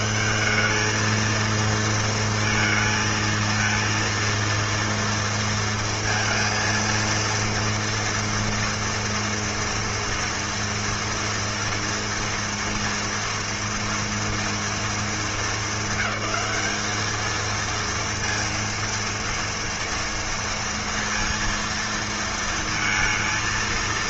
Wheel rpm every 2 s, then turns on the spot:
200, 230, 230, 230, 230, 230, 230, 230, 200, 230, 230, 230.
none